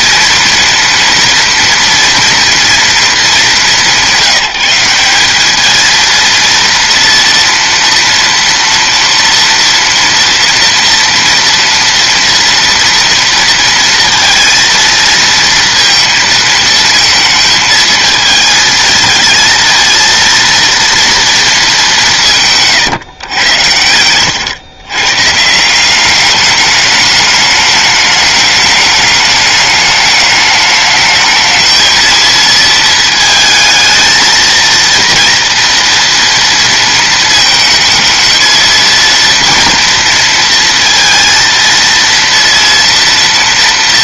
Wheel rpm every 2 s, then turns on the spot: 230, 240, 190, 230, 230, 240, 230, 230, 220, 220, 230, 150, 110, 200, 210, 210, 220, 230, 230, 220, 230, 230.
none